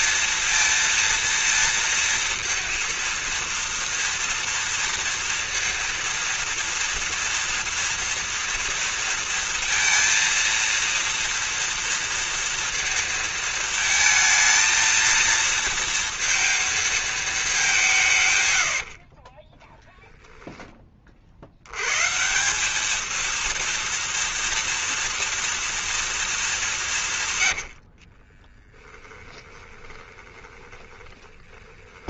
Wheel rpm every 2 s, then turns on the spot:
230, 230, 230, 230, 230, 230, 230, 220, 230, 150, 10, 140, 230, 220, 30, 20.
28-32